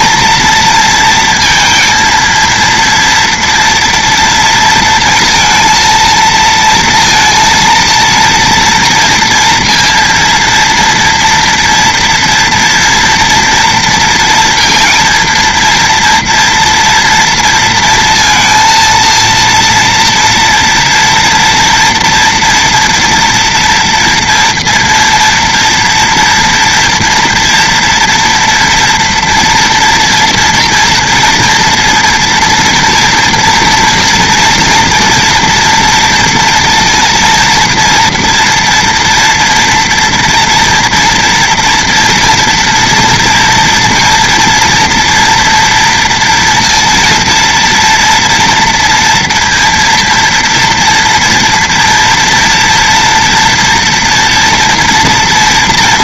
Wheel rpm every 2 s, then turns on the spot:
230, 230, 230, 230, 230, 230, 230, 230, 230, 230, 240, 230, 240, 230, 230, 230, 230, 230, 230, 240, 230, 240, 230, 230, 230, 230, 240, 230.
none